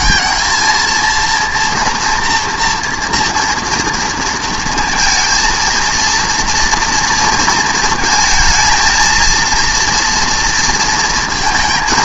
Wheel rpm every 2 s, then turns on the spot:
230, 230, 230, 230, 230, 230.
none